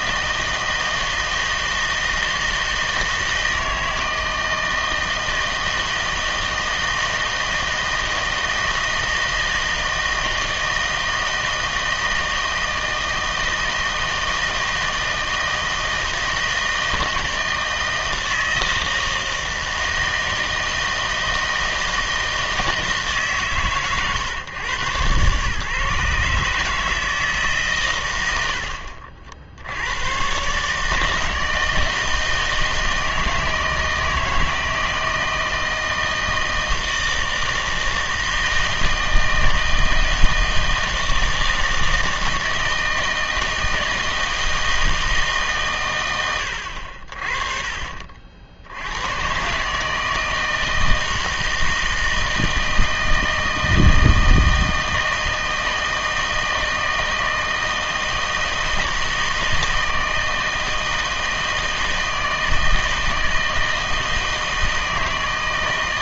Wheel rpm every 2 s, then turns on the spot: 160, 160, 160, 160, 160, 160, 160, 160, 160, 160, 160, 160, 120, 150, 70, 140, 160, 160, 160, 160, 160, 160, 160, 80, 70, 160, 160, 160, 160, 160, 160, 160, 160.
none